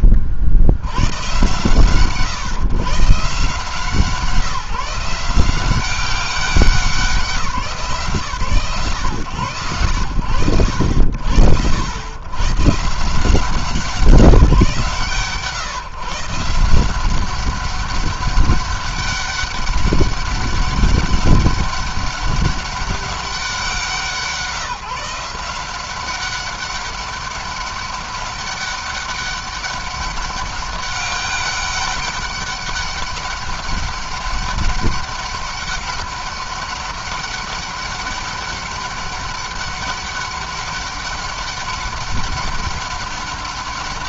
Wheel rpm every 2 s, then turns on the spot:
80, 140, 160, 190, 130, 90, 140, 140, 170, 200, 200, 200, 160, 200, 200, 200, 200, 200, 200, 200, 200, 200.
none